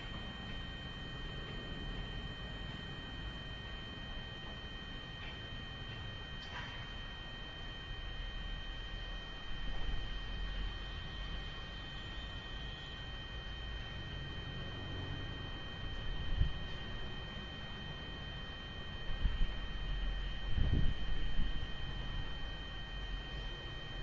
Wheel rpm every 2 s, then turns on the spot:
0, 0, 0, 0, 0, 0, 0, 0, 0, 0, 0, 0.
none